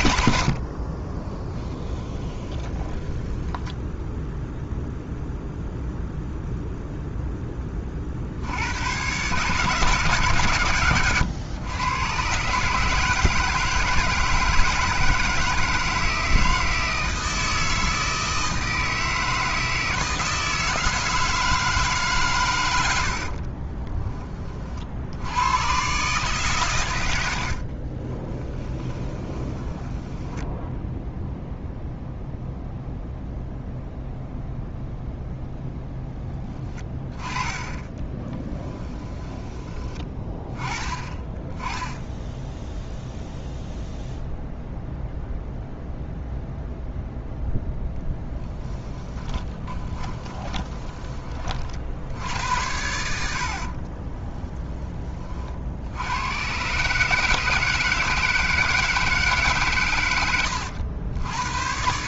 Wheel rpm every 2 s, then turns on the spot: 60, 20, 0, 0, 80, 130, 140, 160, 160, 160, 160, 120, 40, 120, 20, 10, 0, 0, 20, 10, 20, 0, 0, 0, 10, 20, 90, 10, 120, 160, 100.
0-4 28-32 38-40 48-52